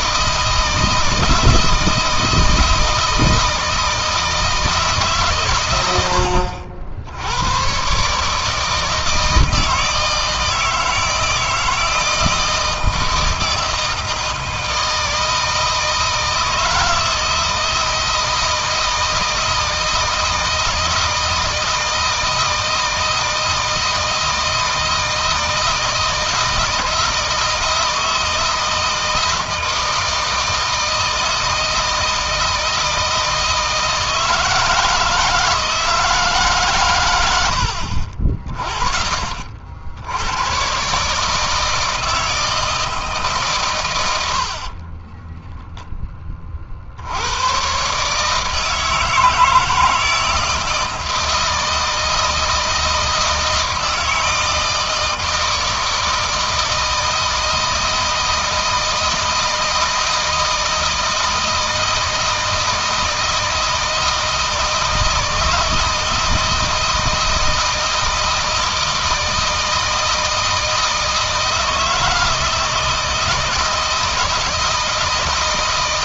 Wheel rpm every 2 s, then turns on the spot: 160, 160, 150, 80, 160, 160, 160, 160, 160, 160, 160, 160, 160, 160, 160, 160, 160, 160, 120, 40, 140, 160, 40, 50, 160, 160, 160, 160, 160, 160, 160, 160, 160, 160, 160, 160, 160, 160.
44-46